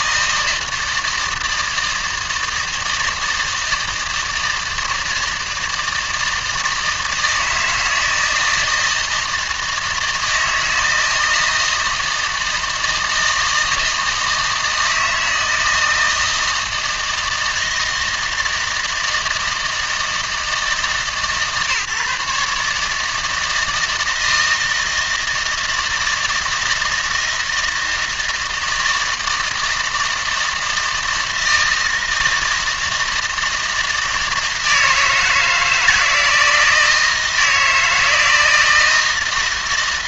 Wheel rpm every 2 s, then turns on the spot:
160, 160, 160, 160, 160, 160, 160, 160, 160, 160, 160, 150, 160, 160, 160, 160, 160, 160, 160, 160.
none